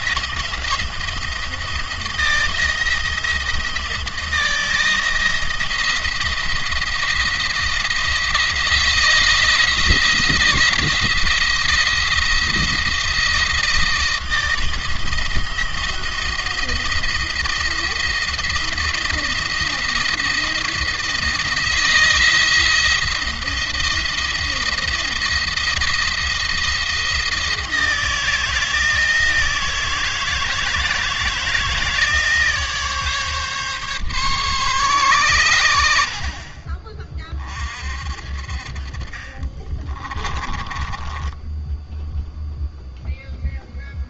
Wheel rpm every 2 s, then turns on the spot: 170, 170, 160, 170, 170, 170, 170, 170, 170, 170, 170, 170, 170, 170, 160, 160, 150, 120, 30, 40, 20, 0.
38-42